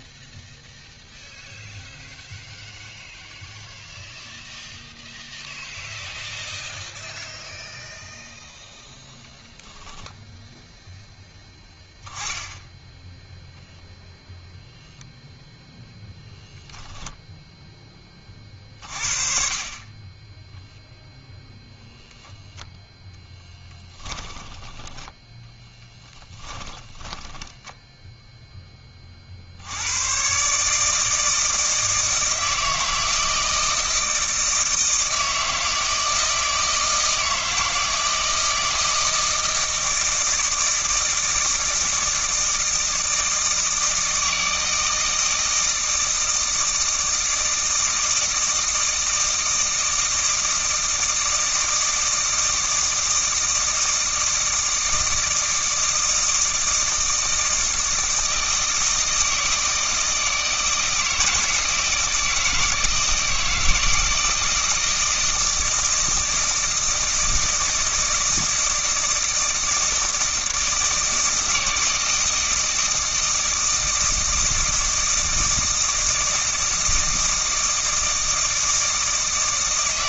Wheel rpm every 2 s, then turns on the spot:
0, 0, 0, 0, 0, 0, 10, 0, 0, 40, 10, 0, 10, 20, 10, 140, 160, 160, 160, 160, 160, 160, 160, 160, 160, 160, 160, 160, 160, 160, 160, 160, 160, 160, 160, 160, 160, 160, 160, 160.
24-28